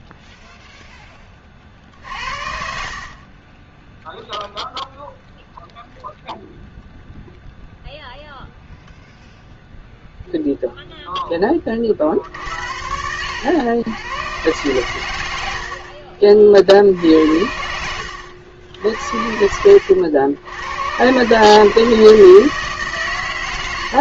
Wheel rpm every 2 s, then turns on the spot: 0, 60, 0, 0, 0, 0, 70, 130, 50, 70, 100, 150.
2-4 12-14